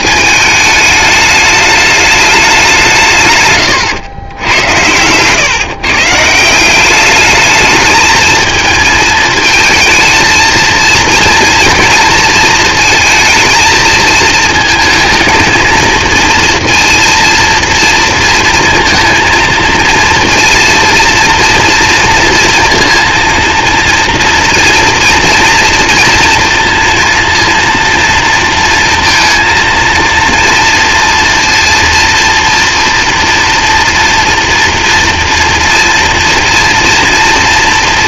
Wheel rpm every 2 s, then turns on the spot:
210, 190, 100, 180, 220, 230, 230, 220, 230, 230, 240, 230, 230, 230, 230, 240, 230, 230, 230.
none